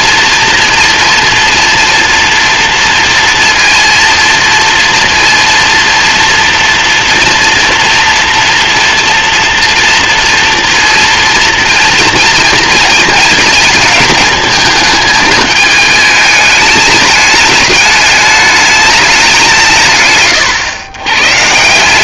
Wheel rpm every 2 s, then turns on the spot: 230, 230, 230, 230, 230, 230, 220, 220, 210, 210, 110.
none